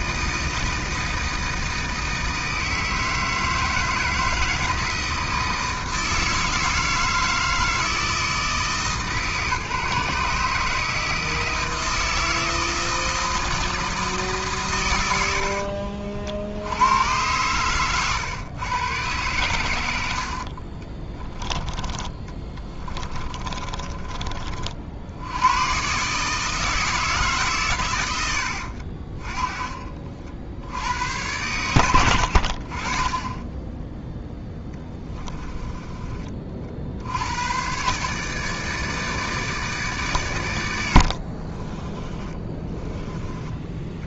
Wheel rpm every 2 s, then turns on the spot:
160, 160, 160, 160, 160, 150, 160, 140, 70, 120, 60, 30, 40, 150, 80, 70, 50, 10, 40, 150, 120, 20.
22-24 42-44